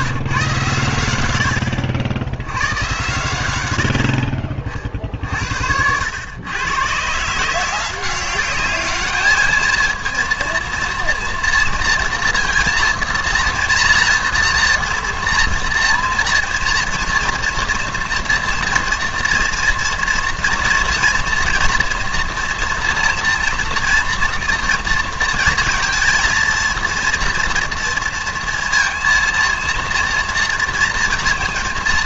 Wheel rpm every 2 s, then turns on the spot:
120, 90, 40, 110, 200, 230, 230, 230, 230, 240, 240, 230, 230, 230, 230, 230.
none